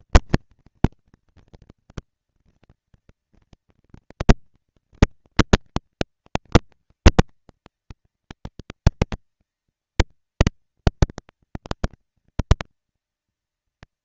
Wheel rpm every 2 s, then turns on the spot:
220, 220, 230, 230, 220, 230, 230.
none